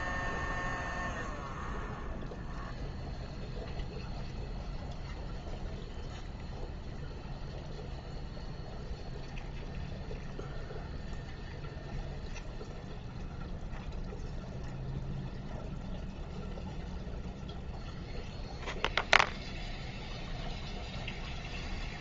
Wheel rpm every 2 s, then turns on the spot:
0, 0, 0, 0, 0, 0, 0, 0, 0, 0, 0.
none